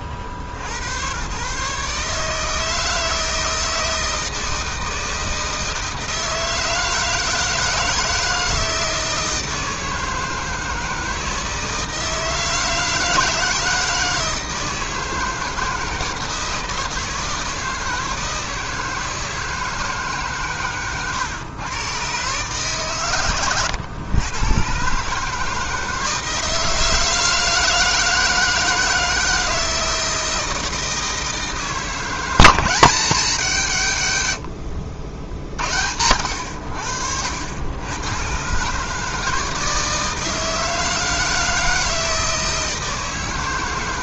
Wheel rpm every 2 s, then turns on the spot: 60, 150, 160, 160, 160, 160, 160, 160, 160, 160, 140, 130, 120, 160, 160, 160, 170, 90, 80, 140, 160, 160.
none